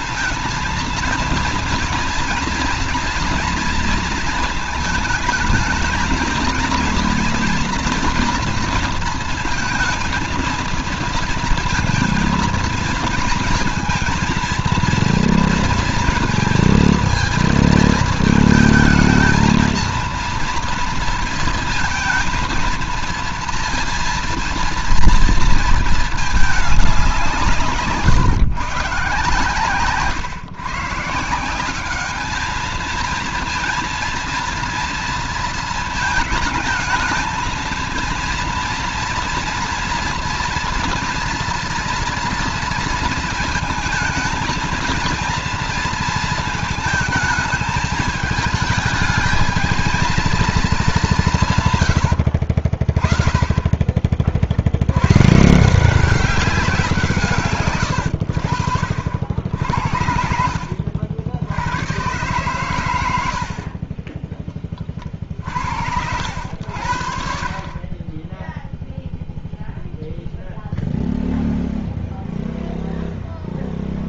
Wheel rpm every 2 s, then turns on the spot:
220, 230, 220, 230, 230, 230, 230, 230, 230, 220, 230, 230, 230, 220, 140, 130, 210, 230, 220, 230, 230, 230, 220, 220, 220, 220, 80, 50, 180, 80, 70, 120, 30, 80, 10, 0, 0.
52-54